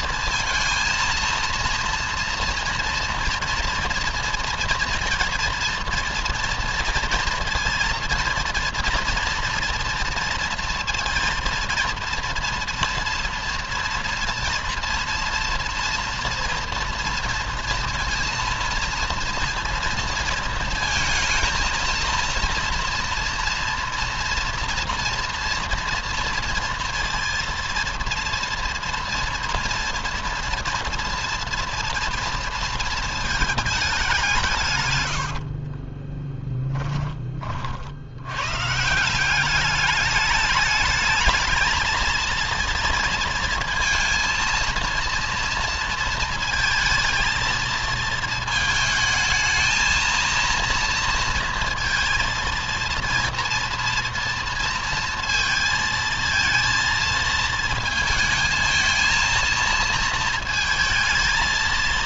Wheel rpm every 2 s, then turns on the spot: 230, 230, 230, 230, 230, 230, 230, 230, 230, 230, 230, 230, 230, 230, 230, 230, 220, 110, 20, 160, 220, 230, 230, 230, 220, 230, 230, 230, 220, 230, 220.
34-36